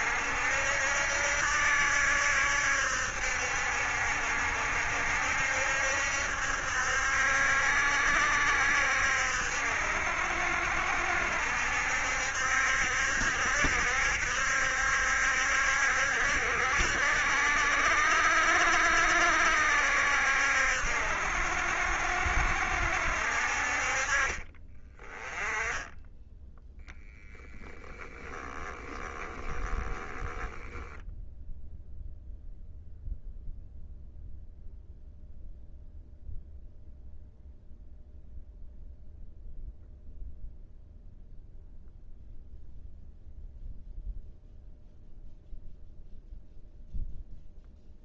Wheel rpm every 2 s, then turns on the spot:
70, 70, 70, 70, 70, 70, 70, 70, 70, 70, 70, 70, 20, 0, 10, 10, 0, 0, 0, 0, 0, 0, 0, 0.
28-30